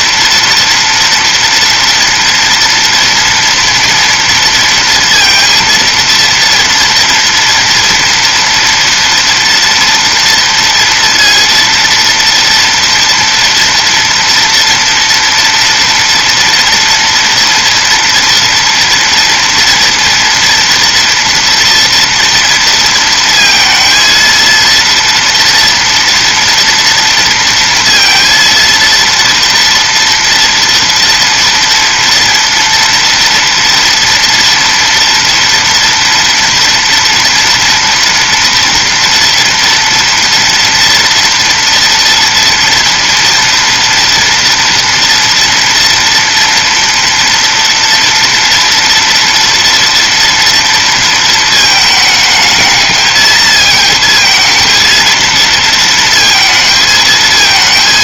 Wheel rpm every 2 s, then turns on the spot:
230, 230, 230, 230, 230, 230, 230, 230, 240, 230, 230, 230, 230, 230, 230, 230, 230, 230, 240, 240, 230, 230, 230, 230, 230, 230, 220, 230, 220.
none